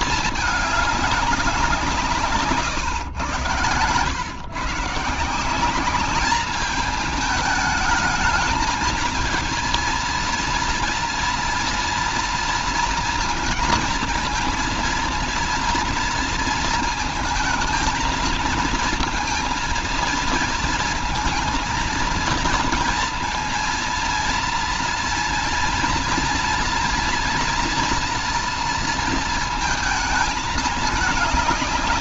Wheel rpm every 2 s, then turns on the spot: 210, 140, 130, 210, 210, 230, 230, 230, 230, 230, 230, 230, 230, 230, 230, 220.
none